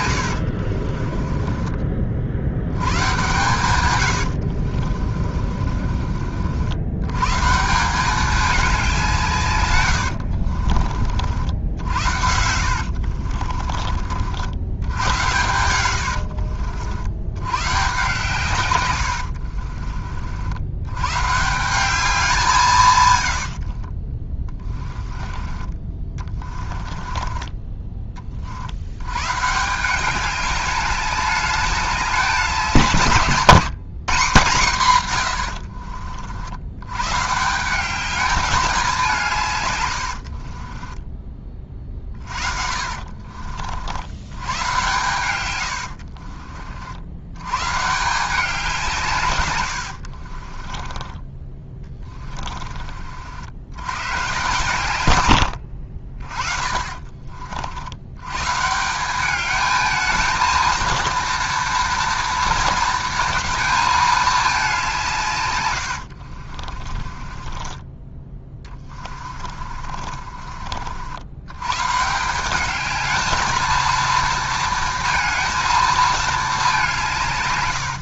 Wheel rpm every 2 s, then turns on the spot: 50, 110, 50, 100, 190, 50, 60, 90, 50, 130, 100, 150, 20, 20, 90, 200, 180, 130, 110, 190, 30, 50, 110, 60, 170, 20, 40, 130, 40, 170, 230, 230, 180, 30, 20, 60, 210, 230, 190.
0-2 4-6 12-14 24-28 40-44 50-52 56-58 66-70